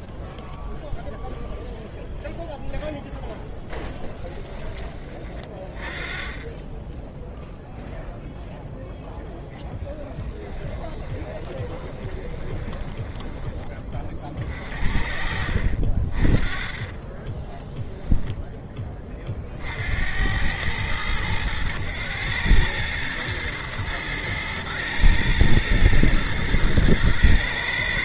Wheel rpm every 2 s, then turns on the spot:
0, 30, 10, 0, 20, 20, 40, 20, 10, 90, 100, 110, 120, 110.
8-12